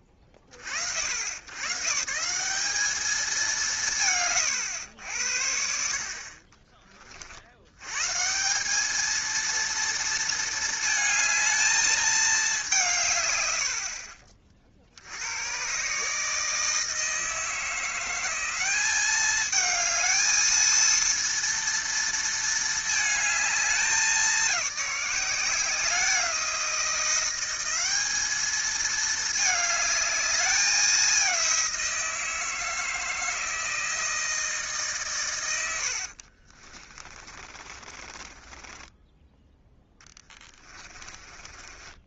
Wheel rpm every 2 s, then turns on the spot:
60, 210, 90, 40, 190, 220, 170, 60, 160, 190, 230, 220, 190, 180, 220, 200, 160, 150, 40, 10, 20.
36-42